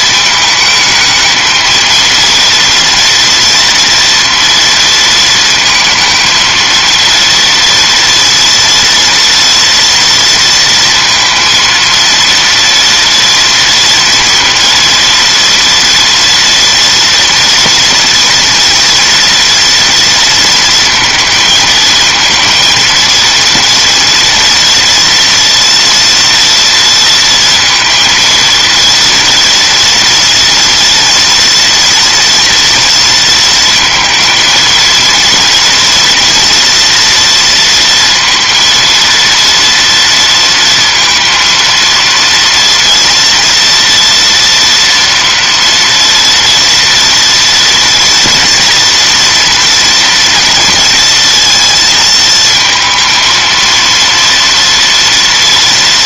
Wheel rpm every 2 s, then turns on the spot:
220, 230, 220, 230, 230, 230, 230, 230, 230, 240, 230, 230, 230, 230, 230, 240, 230, 230, 230, 230, 230, 230, 230, 230, 230, 230, 220, 230.
none